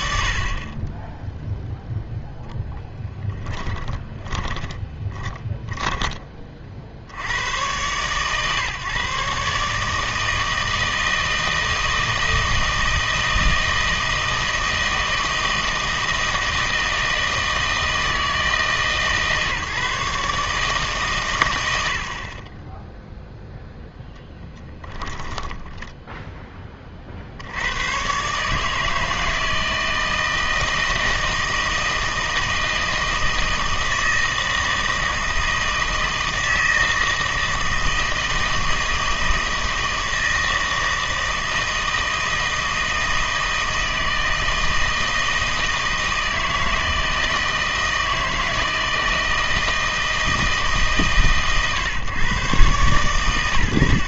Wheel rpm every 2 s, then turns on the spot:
30, 0, 10, 50, 140, 160, 160, 160, 160, 160, 140, 10, 10, 20, 150, 160, 160, 160, 160, 160, 160, 160, 160, 160, 160, 160, 130.
4-6 22-26